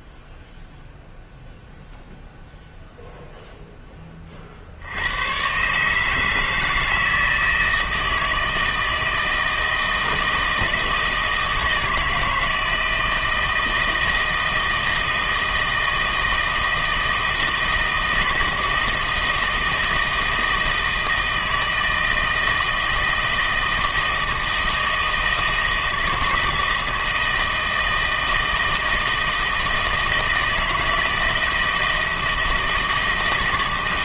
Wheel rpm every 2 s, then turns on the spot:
0, 0, 60, 160, 160, 160, 160, 160, 160, 160, 160, 160, 160, 160, 160, 160, 160.
none